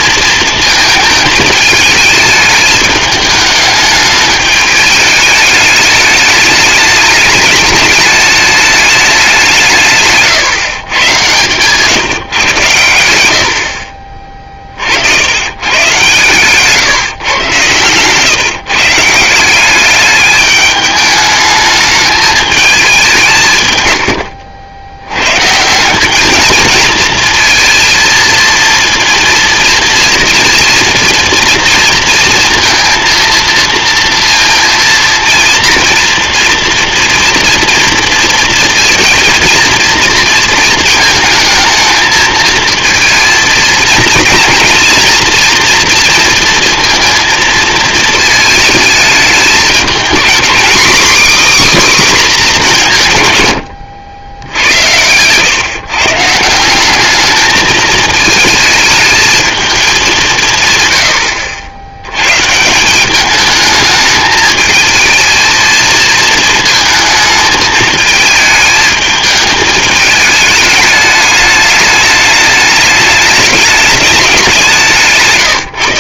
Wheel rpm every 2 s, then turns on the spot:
220, 210, 210, 210, 210, 120, 110, 60, 140, 150, 210, 200, 90, 230, 230, 240, 230, 230, 230, 230, 220, 230, 230, 230, 220, 270, 170, 90, 190, 220, 100, 170, 220, 230, 220, 210, 210, 180.
none